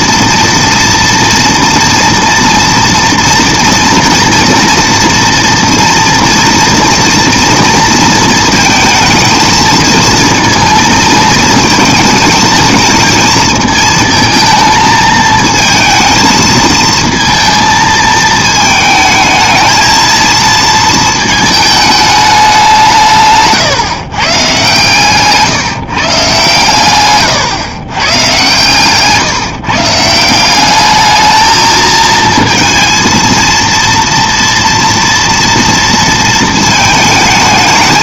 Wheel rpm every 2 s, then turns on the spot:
230, 230, 230, 230, 220, 230, 230, 220, 220, 220, 230, 160, 150, 120, 150, 210, 230, 230, 220.
none